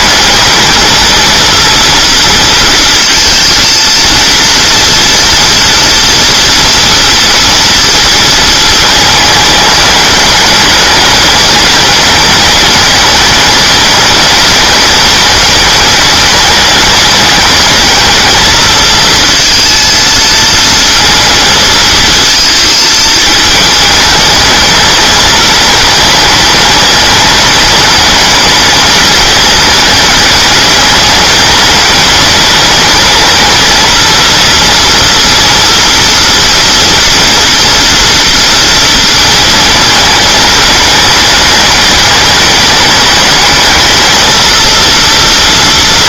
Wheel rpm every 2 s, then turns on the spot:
220, 230, 230, 230, 220, 210, 210, 210, 210, 220, 230, 220, 220, 210, 210, 210, 210, 230, 230, 230, 220, 210, 230.
none